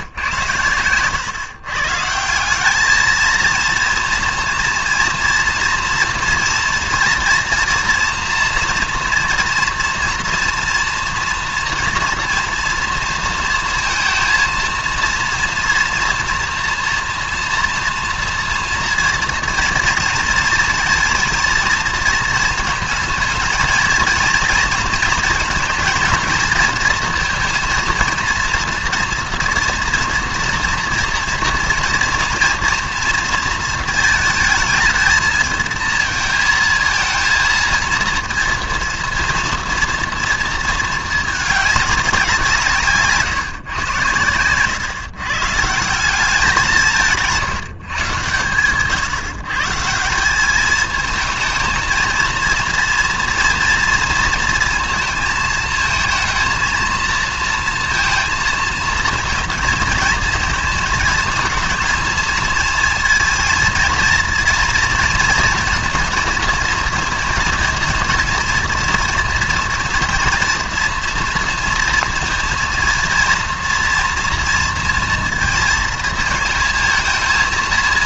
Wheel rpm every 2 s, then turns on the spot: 110, 190, 230, 230, 230, 230, 230, 230, 230, 230, 230, 230, 230, 230, 230, 230, 230, 220, 230, 230, 230, 160, 120, 180, 120, 210, 230, 230, 230, 230, 220, 220, 230, 230, 240, 230, 230, 230, 230.
none